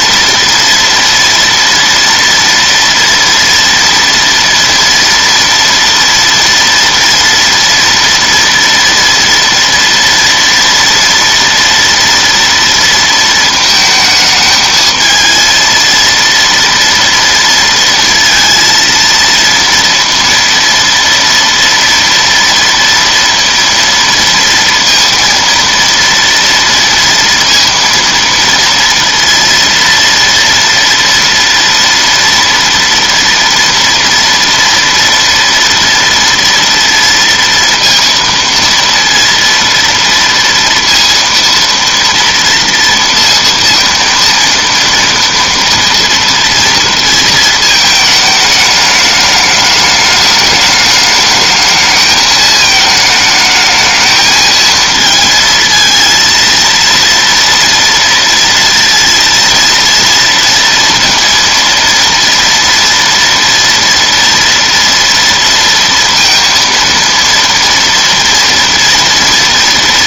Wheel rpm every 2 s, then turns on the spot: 230, 230, 230, 230, 230, 230, 230, 220, 230, 230, 230, 230, 230, 230, 230, 230, 230, 230, 230, 230, 230, 230, 230, 230, 210, 210, 220, 220, 230, 230, 230, 230, 230, 230, 230.
none